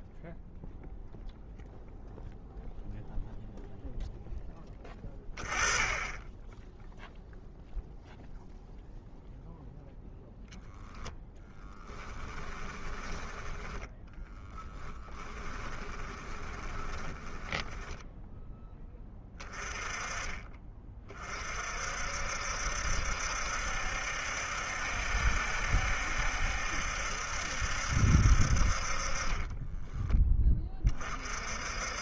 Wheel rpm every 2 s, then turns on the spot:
0, 0, 20, 0, 0, 0, 10, 10, 10, 20, 30, 70, 70, 70, 30, 30.
12-18